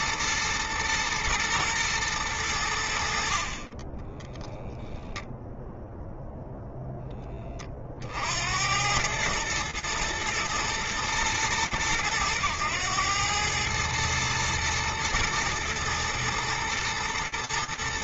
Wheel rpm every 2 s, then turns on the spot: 110, 100, 0, 10, 100, 110, 110, 110, 110.
none